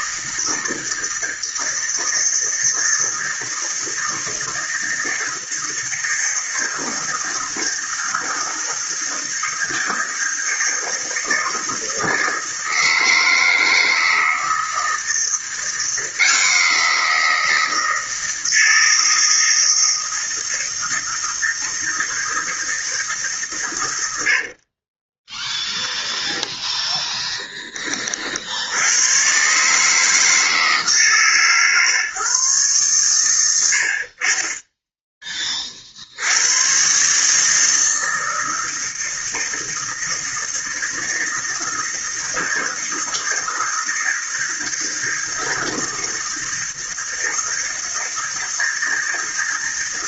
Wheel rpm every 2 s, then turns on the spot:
160, 160, 160, 160, 160, 160, 160, 160, 170, 160, 160, 160, 30, 0, 80, 150, 120, 10, 120, 160, 160, 160, 160, 160, 160.
24-26